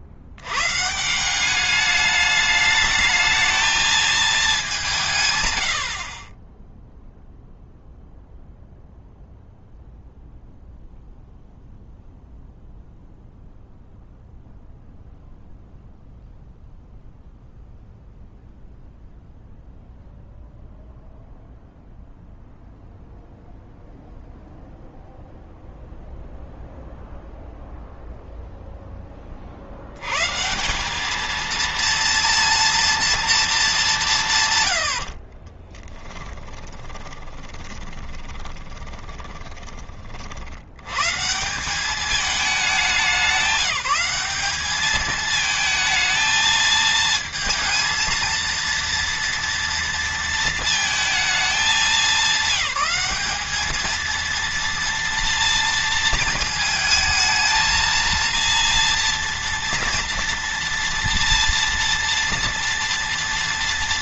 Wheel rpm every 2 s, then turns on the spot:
140, 220, 180, 10, 0, 0, 0, 0, 0, 0, 0, 0, 0, 0, 10, 180, 230, 90, 20, 20, 110, 210, 210, 220, 230, 220, 190, 230, 220, 230, 230, 240.
34-40